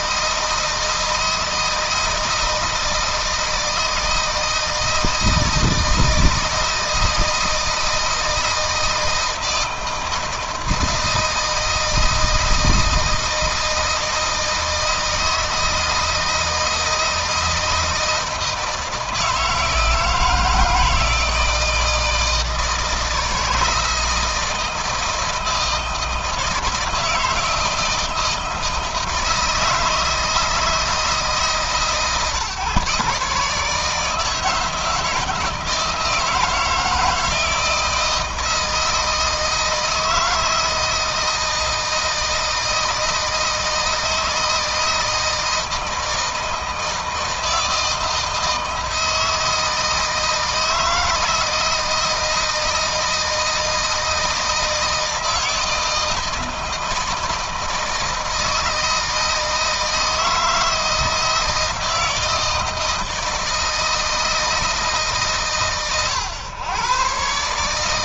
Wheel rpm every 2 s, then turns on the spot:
160, 160, 160, 160, 160, 160, 160, 160, 160, 160, 160, 160, 160, 170, 160, 160, 140, 160, 160, 160, 160, 160, 160, 160, 160, 160, 160, 160, 160, 160, 160, 160, 160, 130.
none